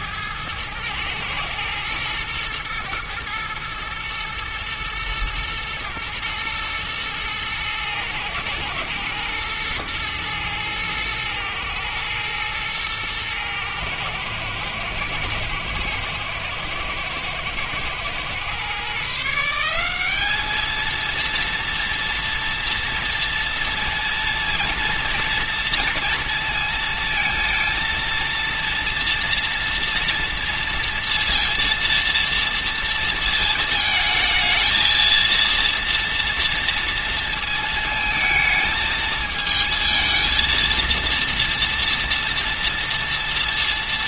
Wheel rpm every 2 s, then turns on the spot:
110, 110, 120, 120, 110, 110, 120, 110, 110, 140, 220, 230, 230, 230, 230, 230, 220, 220, 230, 220, 230, 230.
none